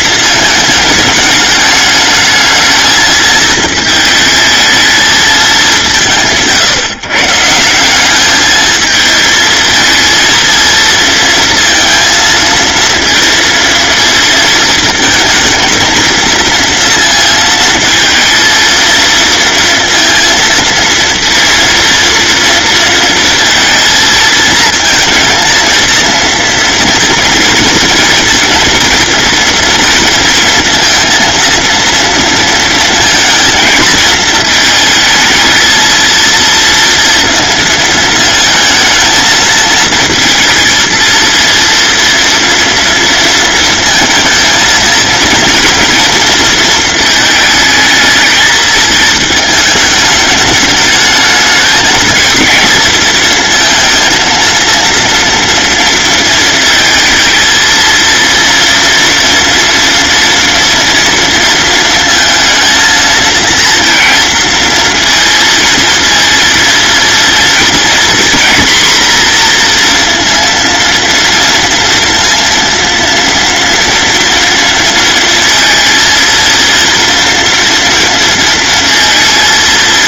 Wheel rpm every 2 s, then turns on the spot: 220, 220, 220, 130, 220, 230, 230, 230, 230, 230, 230, 230, 230, 230, 230, 230, 230, 220, 230, 220, 230, 230, 230, 220, 220, 210, 230, 230, 220, 230, 230, 230, 230, 230, 240, 230, 230, 230, 230, 230.
none